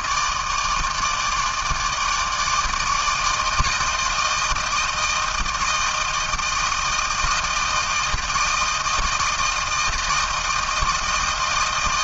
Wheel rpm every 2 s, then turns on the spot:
160, 150, 160, 160, 160, 160.
none